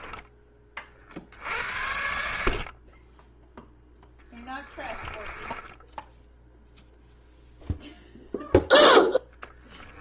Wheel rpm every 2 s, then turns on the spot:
40, 30, 20, 0, 10.
4-6 8-10